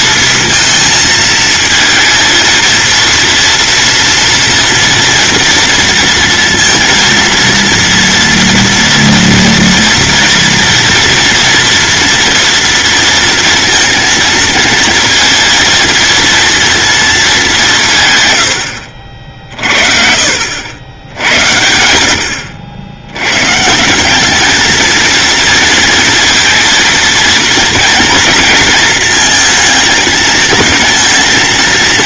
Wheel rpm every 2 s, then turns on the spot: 220, 230, 230, 230, 230, 230, 230, 230, 230, 90, 90, 80, 220, 230, 230, 230.
none